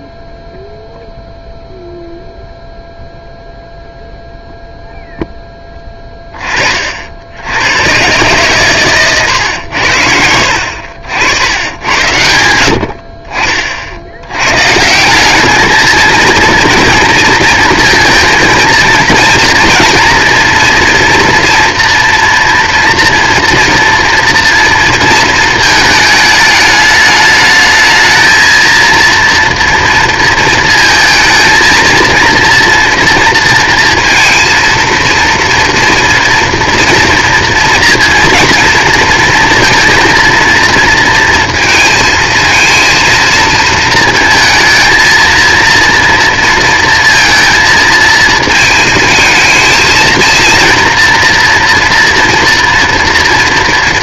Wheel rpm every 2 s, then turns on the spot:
0, 0, 0, 40, 120, 80, 60, 140, 230, 230, 230, 230, 230, 210, 230, 220, 230, 230, 230, 230, 230, 230, 220, 230, 220, 230, 230.
none